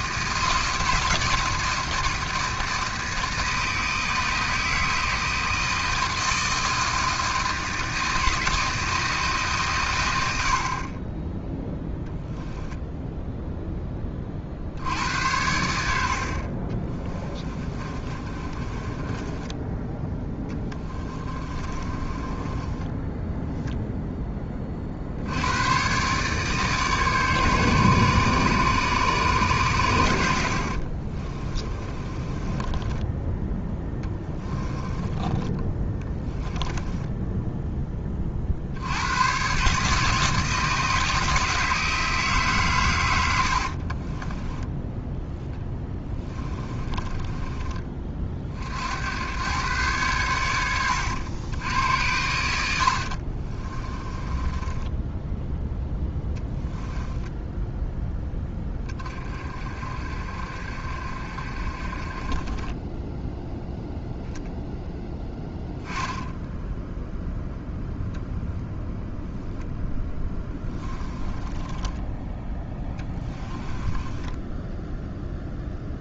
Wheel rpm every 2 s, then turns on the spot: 160, 160, 160, 160, 160, 40, 0, 70, 30, 20, 20, 20, 40, 150, 140, 50, 20, 20, 10, 70, 160, 120, 10, 20, 70, 90, 80, 10, 0, 20, 50, 10, 0, 0, 0, 10, 10, 0.
16-24 30-38 46-48 52-56 70-74